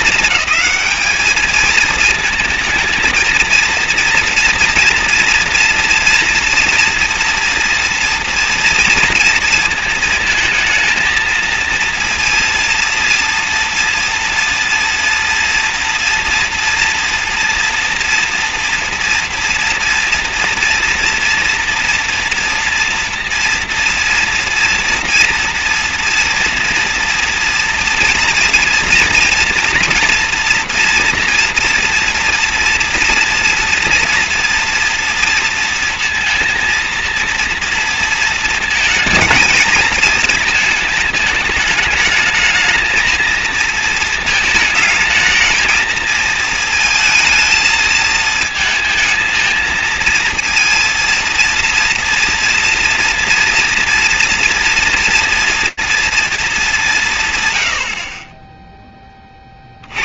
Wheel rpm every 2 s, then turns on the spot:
220, 230, 230, 230, 230, 220, 230, 230, 240, 230, 230, 230, 240, 230, 230, 230, 230, 230, 230, 230, 220, 220, 220, 230, 220, 230, 240, 230, 210, 10.
none